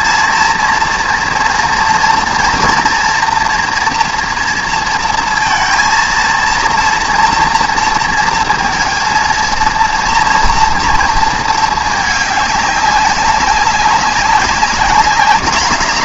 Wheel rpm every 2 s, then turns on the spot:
230, 230, 230, 230, 230, 240, 200, 200.
none